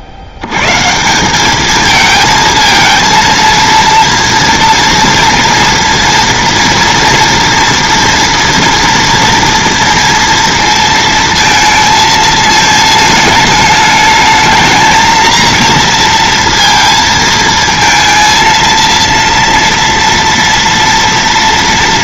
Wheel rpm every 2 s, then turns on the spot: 120, 220, 230, 230, 230, 230, 220, 220, 230, 230, 230.
none